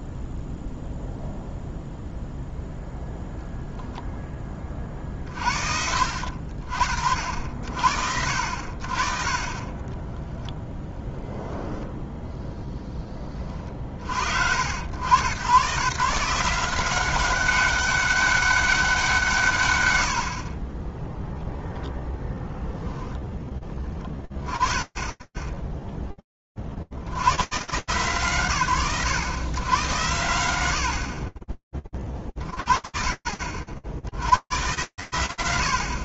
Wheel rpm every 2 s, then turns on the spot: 0, 0, 30, 60, 50, 10, 10, 70, 180, 190, 20, 0, 30, 110, 60, 60, 30, 90.
10-12